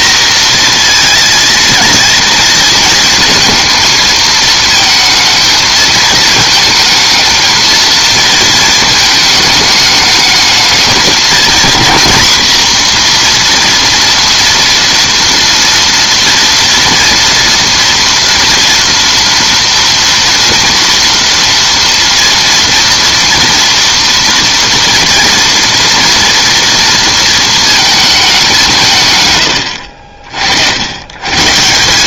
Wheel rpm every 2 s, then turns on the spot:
230, 230, 220, 220, 220, 220, 240, 230, 230, 230, 230, 230, 230, 230, 170, 80.
none